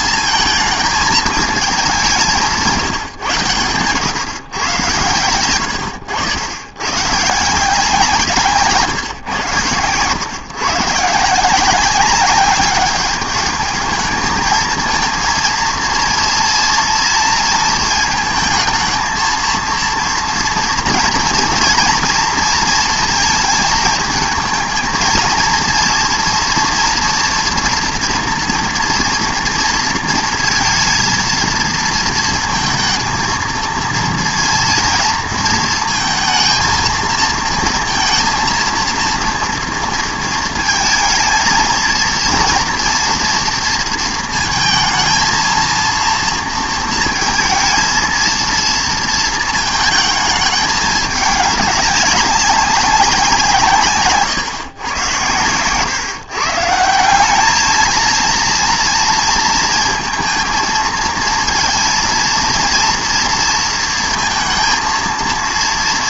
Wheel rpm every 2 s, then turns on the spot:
220, 160, 120, 100, 150, 130, 200, 220, 230, 220, 230, 230, 220, 230, 230, 230, 220, 230, 230, 230, 220, 230, 220, 230, 230, 210, 190, 130, 150, 230, 230, 230, 230.
none